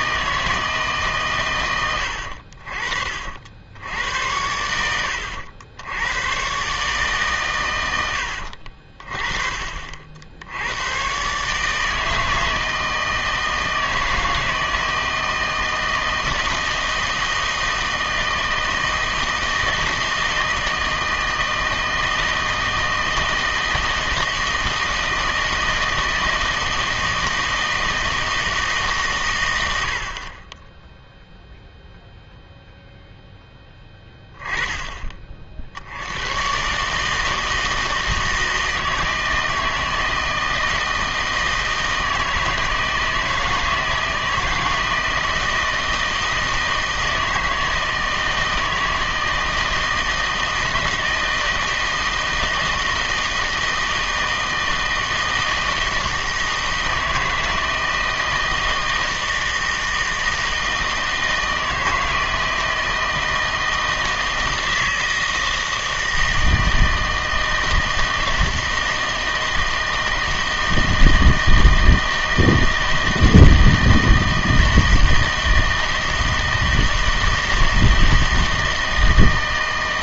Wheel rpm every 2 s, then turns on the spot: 150, 50, 90, 130, 60, 90, 160, 160, 160, 160, 160, 160, 160, 160, 150, 10, 0, 10, 130, 160, 160, 160, 160, 160, 160, 160, 160, 160, 160, 160, 160, 160, 160, 160, 160, 160, 160, 160, 160, 160.
none